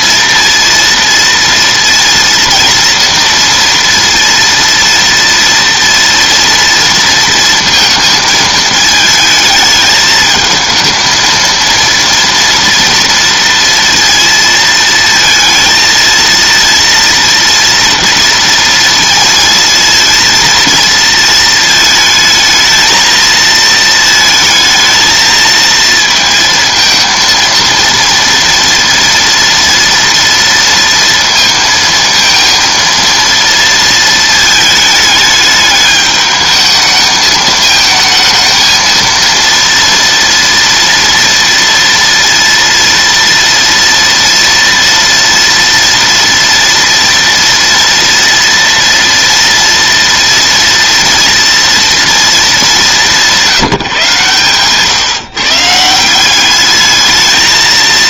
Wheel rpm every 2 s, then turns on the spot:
230, 230, 230, 230, 220, 220, 230, 230, 230, 230, 230, 220, 220, 230, 230, 230, 230, 220, 210, 220, 230, 230, 230, 230, 230, 240, 210, 130, 200.
none